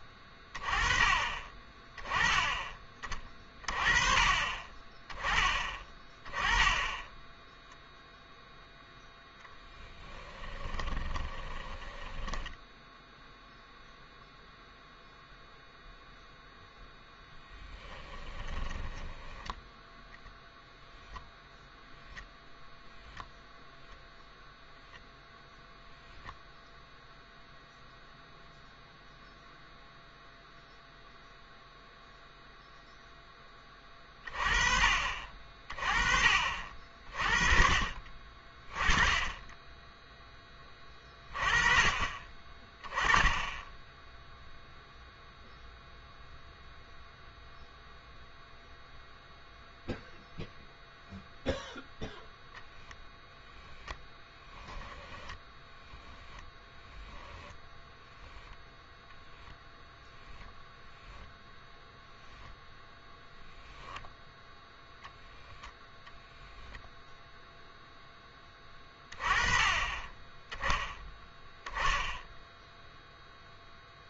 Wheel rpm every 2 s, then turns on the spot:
20, 20, 20, 10, 0, 20, 10, 0, 0, 10, 0, 10, 0, 0, 0, 0, 0, 30, 50, 30, 20, 20, 0, 0, 0, 0, 10, 10, 0, 0, 0, 0, 0, 0, 20, 10, 0.
10-14 18-20